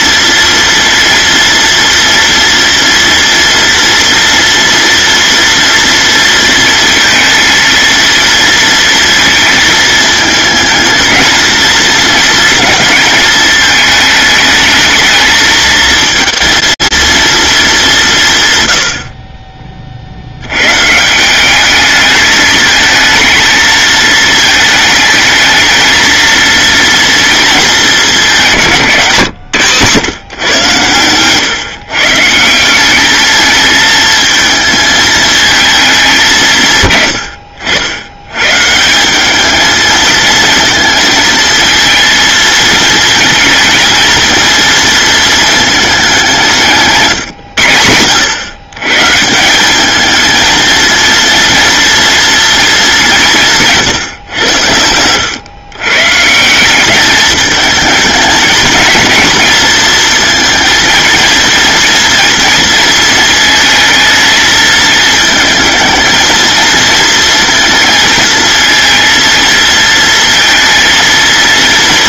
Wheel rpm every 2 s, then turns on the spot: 230, 230, 230, 230, 230, 220, 220, 220, 230, 50, 170, 220, 220, 230, 160, 120, 210, 220, 120, 170, 220, 220, 230, 150, 130, 230, 200, 90, 200, 230, 230, 230, 220, 230, 230, 230.
30-32